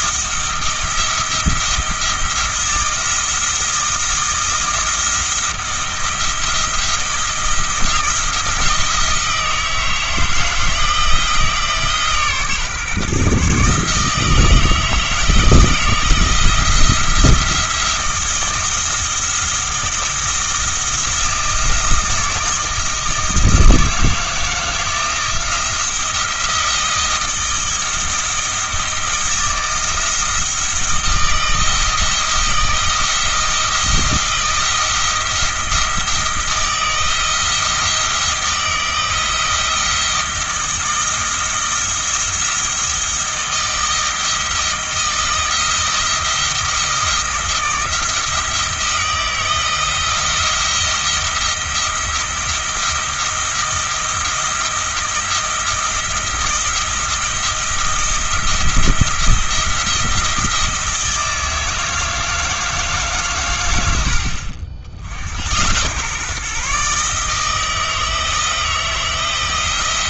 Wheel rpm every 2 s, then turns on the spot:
170, 170, 170, 170, 160, 160, 140, 160, 170, 170, 170, 160, 160, 160, 160, 170, 160, 160, 170, 160, 170, 160, 170, 170, 170, 170, 170, 170, 170, 170, 160, 160, 70, 150, 170.
none